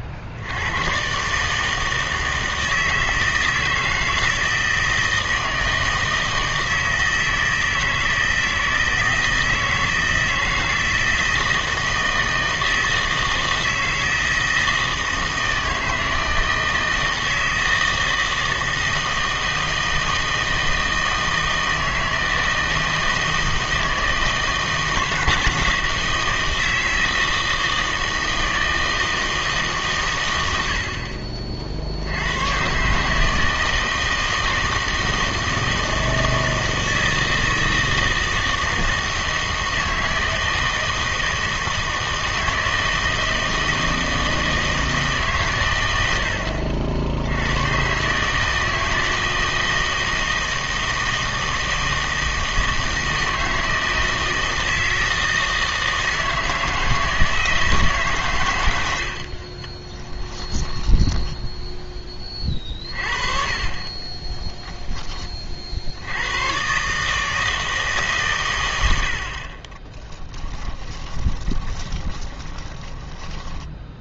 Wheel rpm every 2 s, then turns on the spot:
100, 160, 160, 160, 160, 160, 160, 160, 160, 160, 160, 160, 160, 160, 160, 80, 130, 160, 160, 160, 160, 160, 160, 70, 160, 160, 160, 160, 160, 100, 10, 40, 10, 130, 110, 10, 20.
60-62 70-74